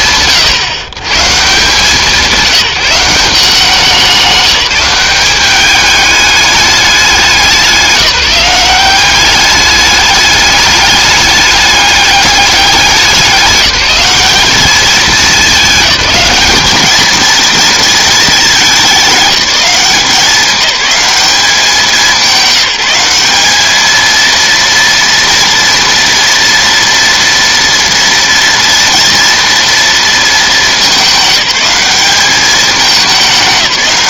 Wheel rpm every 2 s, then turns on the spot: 130, 190, 200, 190, 190, 210, 190, 210, 220, 200, 200, 190, 230, 230, 230, 200, 210.
none